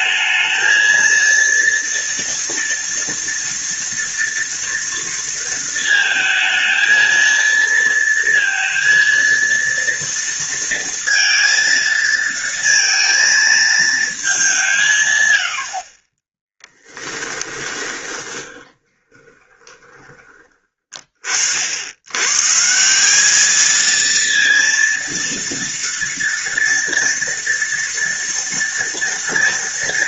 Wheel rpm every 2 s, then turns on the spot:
230, 230, 230, 230, 230, 230, 230, 110, 10, 20, 50, 200, 230, 230, 230.
16-20